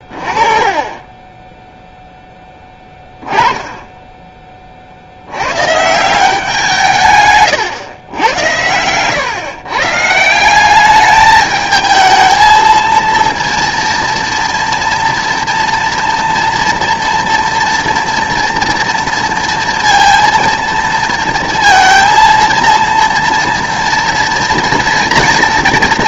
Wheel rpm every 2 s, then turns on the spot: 20, 10, 30, 170, 100, 180, 230, 230, 230, 230, 230, 230, 230.
none